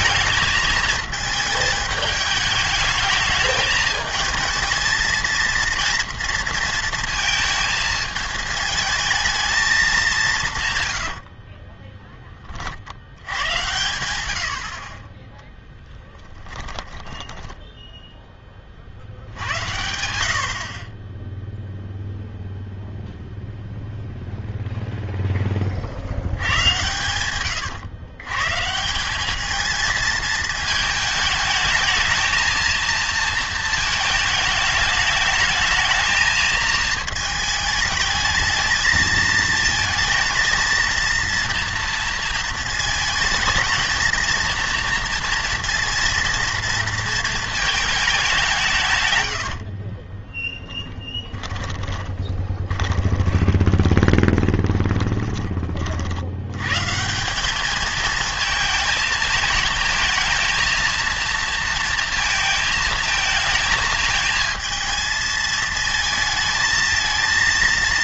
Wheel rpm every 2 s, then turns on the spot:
220, 210, 220, 230, 220, 130, 50, 50, 10, 40, 40, 0, 0, 100, 140, 220, 230, 220, 220, 220, 230, 230, 240, 230, 170, 10, 20, 20, 120, 220, 230, 220, 220, 220.
16-18 50-56